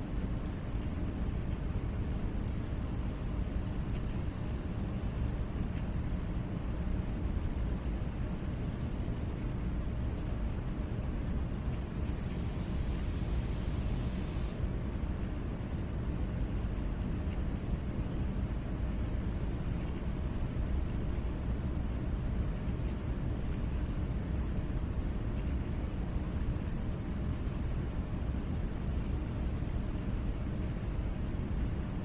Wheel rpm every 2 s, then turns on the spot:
0, 0, 0, 0, 0, 0, 0, 0, 0, 0, 0, 0, 0, 0, 0, 0.
none